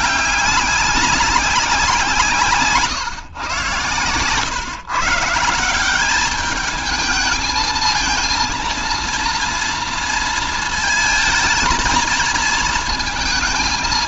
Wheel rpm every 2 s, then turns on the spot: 190, 130, 150, 220, 230, 230, 220.
none